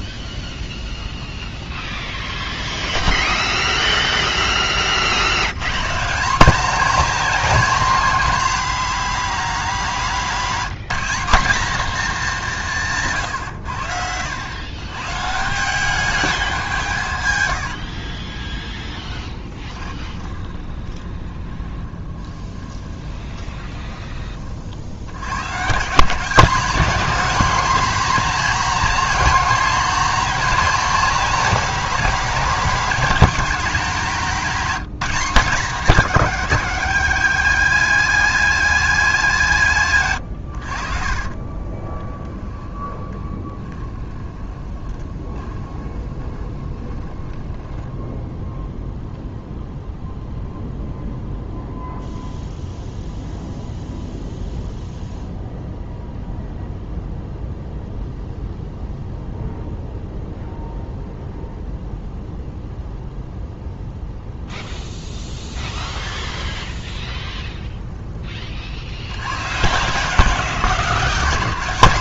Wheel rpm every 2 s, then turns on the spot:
0, 0, 30, 240, 230, 200, 150, 140, 150, 20, 20, 20, 80, 200, 250, 240, 220, 210, 210, 200, 40, 20, 20, 20, 0, 0, 0, 0, 0, 0, 0, 0, 0, 0, 60, 180.
18-24 40-48